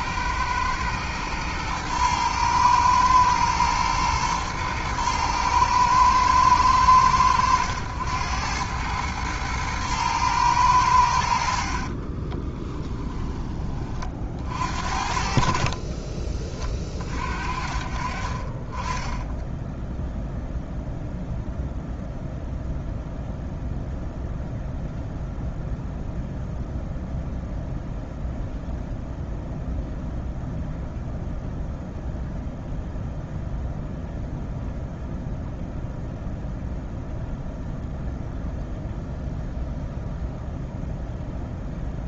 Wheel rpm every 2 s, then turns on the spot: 110, 110, 110, 100, 100, 110, 20, 50, 30, 30, 0, 0, 0, 0, 0, 0, 0, 0, 0, 0, 0.
12-14